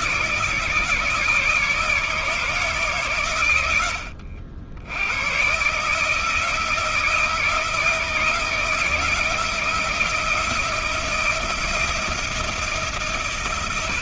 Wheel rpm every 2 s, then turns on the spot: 150, 150, 80, 160, 160, 170, 140.
none